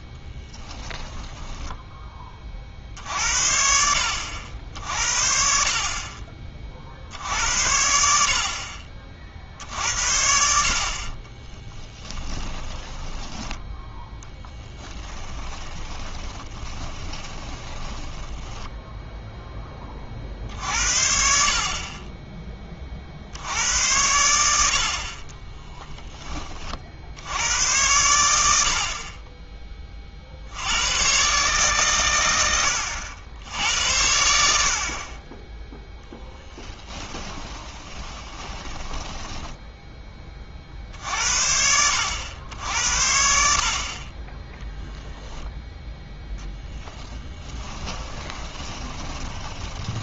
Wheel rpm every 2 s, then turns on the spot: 10, 50, 60, 50, 50, 60, 20, 10, 20, 10, 60, 20, 70, 40, 60, 90, 80, 60, 20, 10, 50, 80, 10, 10, 20.
12-20 36-40 48-50